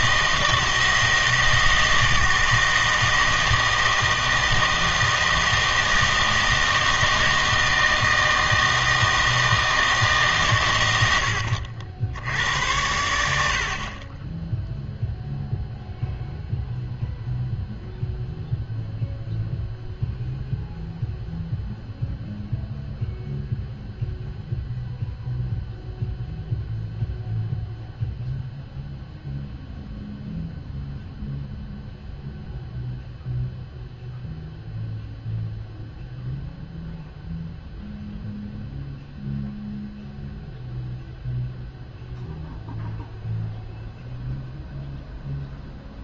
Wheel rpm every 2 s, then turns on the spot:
160, 160, 160, 160, 160, 140, 90, 0, 0, 0, 0, 0, 0, 0, 0, 0, 0, 0, 0, 0, 0, 0, 0.
none